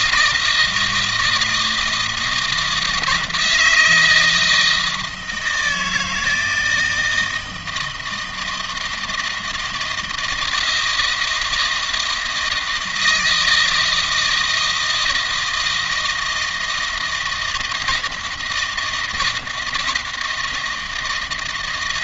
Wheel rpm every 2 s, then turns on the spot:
160, 160, 160, 160, 160, 160, 160, 160, 160, 170, 160.
none